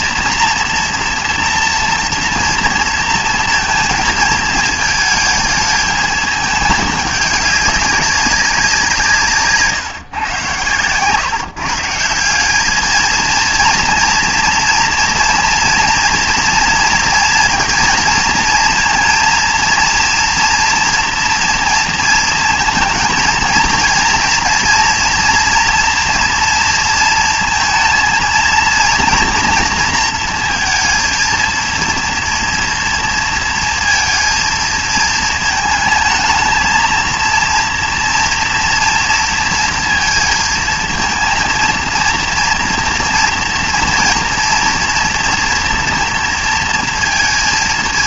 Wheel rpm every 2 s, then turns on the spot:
240, 230, 220, 210, 190, 130, 200, 230, 230, 230, 240, 230, 240, 230, 230, 230, 240, 230, 220, 230, 230, 240, 230, 230.
none